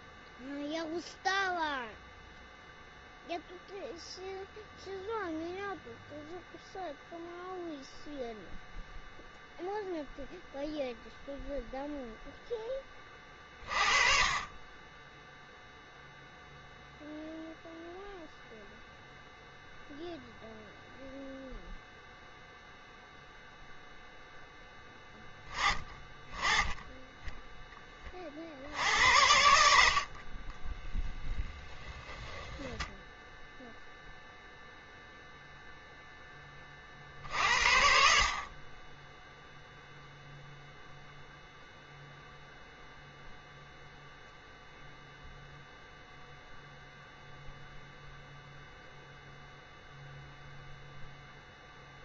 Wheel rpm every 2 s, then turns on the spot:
0, 0, 0, 0, 0, 0, 10, 20, 0, 0, 0, 0, 10, 20, 70, 20, 10, 0, 30, 30, 0, 0, 0, 0, 0, 0.
30-34